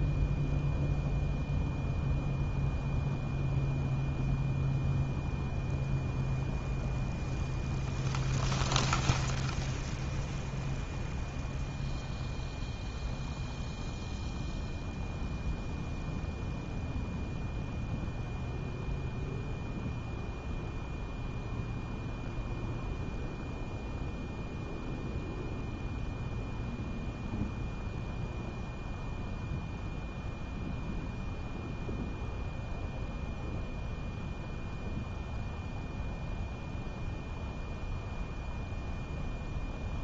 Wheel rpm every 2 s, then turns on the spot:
0, 0, 0, 0, 0, 0, 0, 0, 0, 0, 0, 0, 0, 0, 0, 0, 0, 0, 0, 0.
none